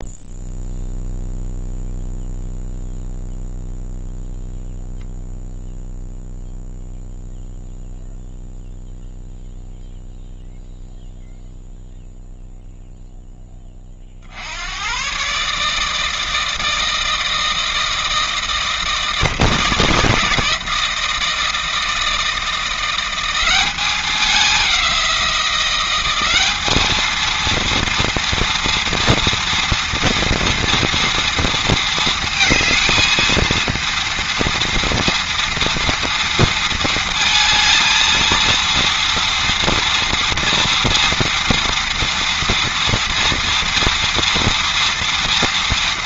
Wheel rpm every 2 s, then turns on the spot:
0, 0, 0, 0, 0, 0, 0, 100, 160, 160, 160, 170, 190, 210, 230, 230, 220, 230, 230, 230, 230, 230, 230.
none